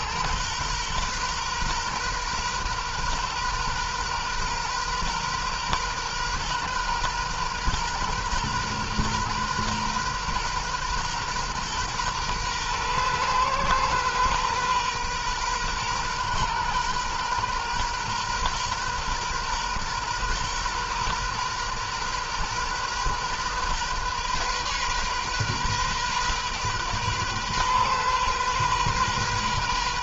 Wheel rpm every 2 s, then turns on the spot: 120, 120, 130, 130, 120, 120, 120, 120, 120, 130, 120, 120, 130, 130, 130.
none